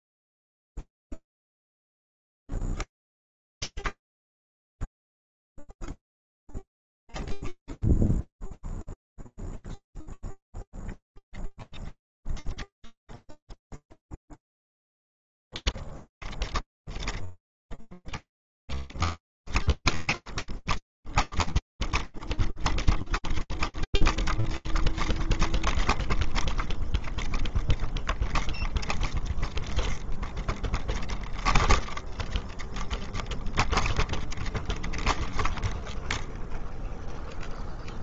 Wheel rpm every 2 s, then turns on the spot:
0, 0, 0, 0, 0, 0, 0, 0, 0, 0, 0, 0, 0, 0, 0, 0, 0, 0, 0.
none